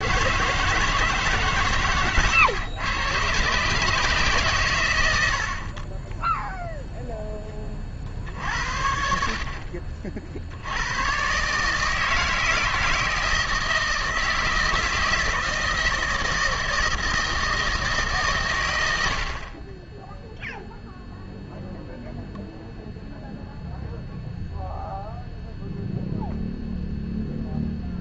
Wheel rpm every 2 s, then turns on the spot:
160, 120, 90, 0, 60, 100, 160, 160, 160, 80, 0, 0, 0, 0.
none